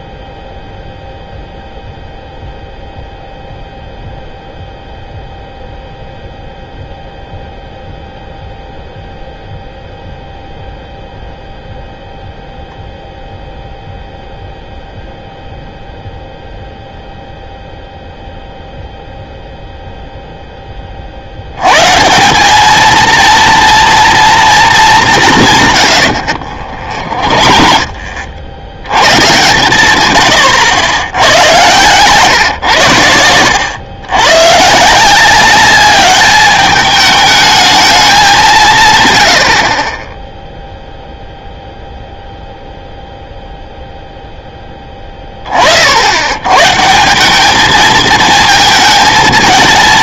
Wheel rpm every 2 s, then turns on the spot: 0, 0, 0, 0, 0, 0, 0, 0, 0, 0, 10, 210, 220, 50, 80, 90, 120, 130, 210, 160, 0, 0, 10, 130, 220.
26-28 30-32